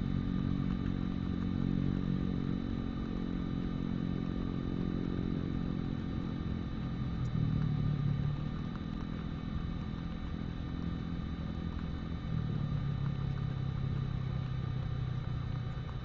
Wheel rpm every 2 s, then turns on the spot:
0, 0, 0, 0, 0, 0, 0, 0.
none